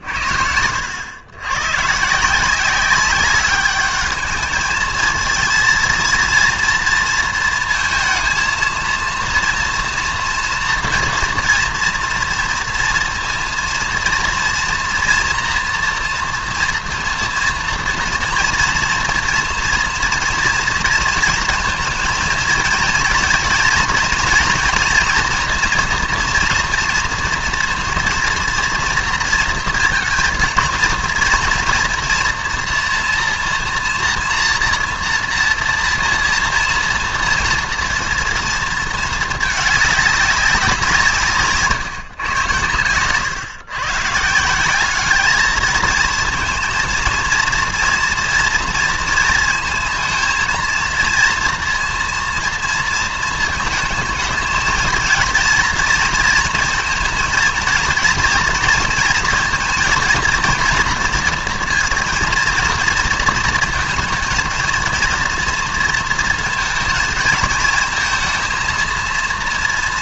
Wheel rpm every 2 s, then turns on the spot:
80, 190, 220, 230, 230, 240, 230, 230, 230, 230, 230, 230, 230, 240, 230, 220, 240, 240, 230, 230, 190, 110, 180, 230, 230, 230, 230, 220, 230, 230, 230, 230, 230, 220, 230.
none